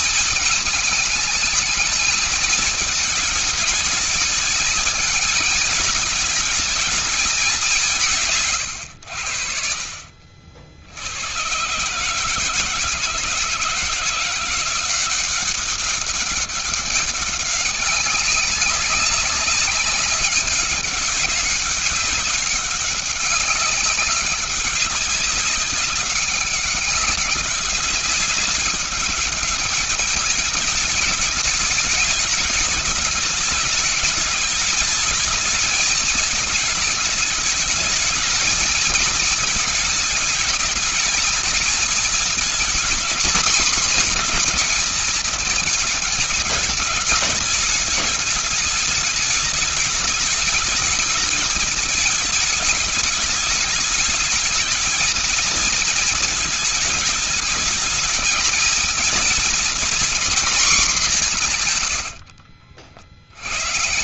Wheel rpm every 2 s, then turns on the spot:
220, 220, 220, 200, 70, 80, 160, 180, 200, 200, 200, 200, 190, 190, 200, 210, 210, 220, 220, 220, 220, 230, 230, 210, 210, 210, 210, 220, 220, 230, 220, 60.
none